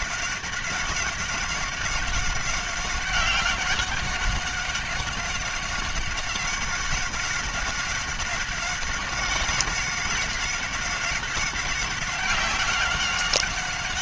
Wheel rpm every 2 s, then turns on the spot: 190, 190, 190, 190, 190, 190, 190.
none